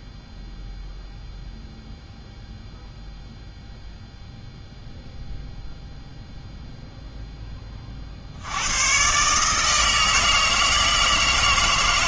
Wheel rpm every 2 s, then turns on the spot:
0, 0, 0, 0, 110, 160.
none